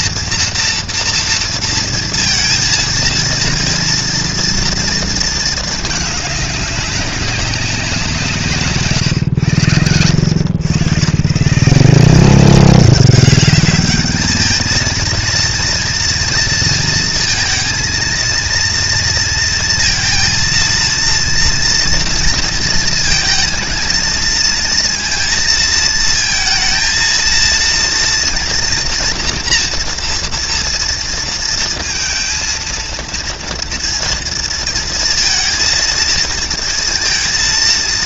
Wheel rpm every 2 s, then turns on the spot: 230, 230, 230, 200, 160, 120, 180, 210, 230, 230, 230, 230, 230, 230, 230, 230, 230, 230, 230.
none